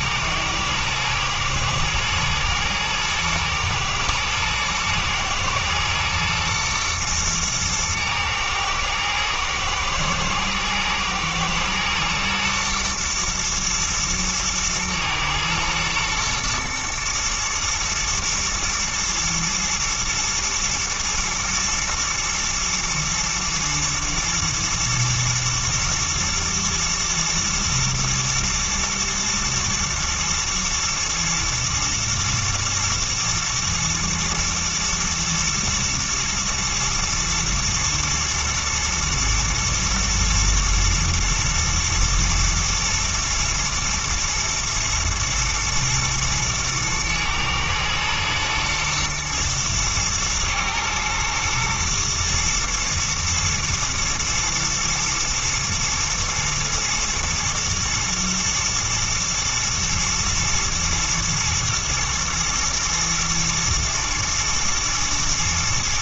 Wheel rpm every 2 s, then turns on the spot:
110, 110, 110, 120, 110, 110, 120, 110, 110, 110, 110, 120, 110, 110, 120, 110, 120, 120, 110, 110, 110, 120, 120, 120, 120, 120, 120, 110, 120, 110, 110, 110, 110.
none